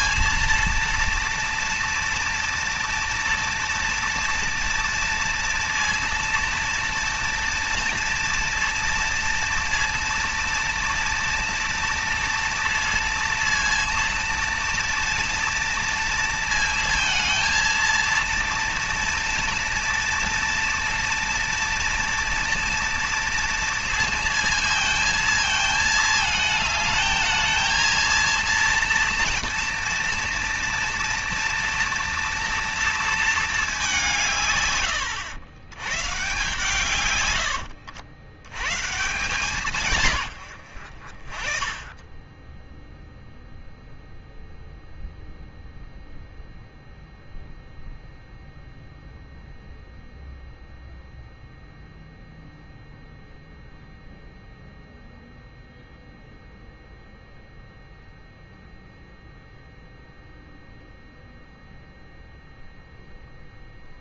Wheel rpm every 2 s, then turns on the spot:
230, 230, 230, 230, 230, 230, 230, 230, 230, 230, 230, 230, 230, 220, 230, 230, 230, 140, 140, 100, 100, 10, 0, 0, 0, 0, 0, 0, 0, 0, 0, 0.
none